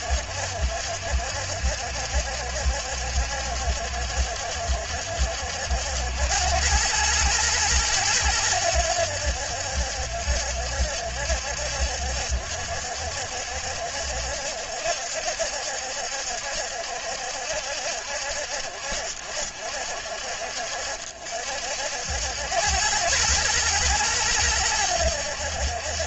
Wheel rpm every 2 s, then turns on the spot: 70, 70, 70, 100, 90, 70, 70, 70, 70, 60, 60, 100, 90.
none